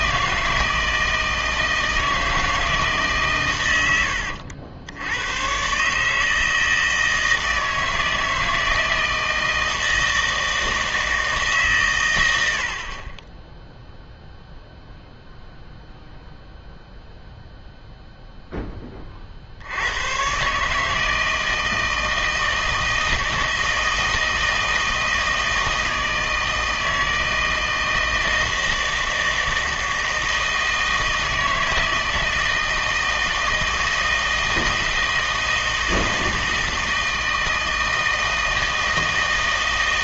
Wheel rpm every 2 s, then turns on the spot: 160, 160, 90, 160, 160, 160, 50, 0, 0, 10, 150, 160, 160, 160, 160, 160, 160, 160, 160, 160.
none